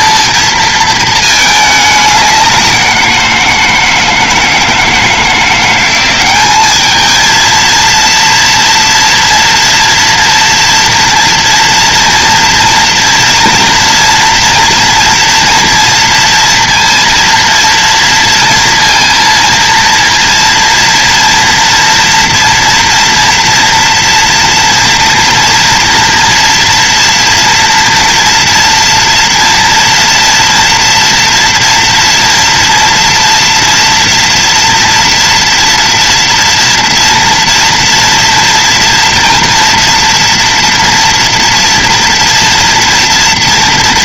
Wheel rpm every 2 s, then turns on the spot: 220, 180, 160, 220, 230, 230, 230, 230, 240, 230, 230, 230, 230, 240, 230, 230, 230, 230, 230, 240, 230, 230.
none